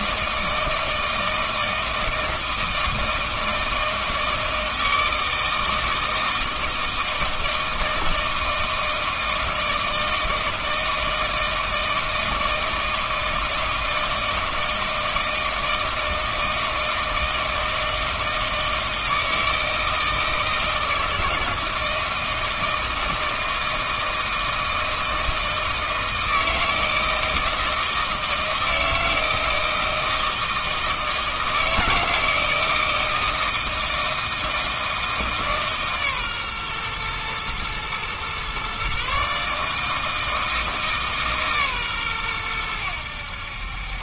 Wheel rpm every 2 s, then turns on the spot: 160, 160, 160, 160, 160, 160, 160, 160, 160, 160, 160, 160, 160, 160, 160, 160, 160, 160, 130, 130, 160, 100.
none